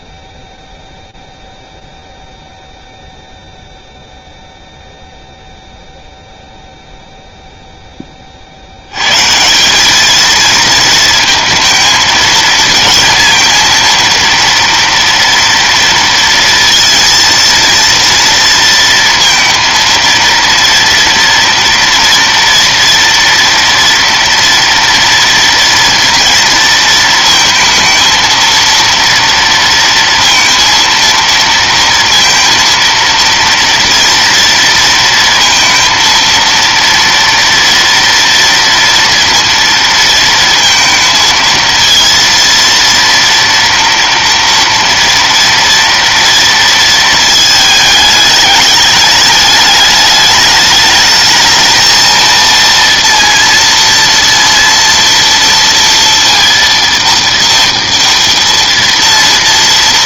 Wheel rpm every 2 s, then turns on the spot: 0, 0, 0, 0, 160, 230, 230, 230, 230, 230, 240, 230, 230, 220, 230, 230, 230, 230, 230, 230, 230, 230, 230, 220, 210, 220, 230, 230, 230, 230.
none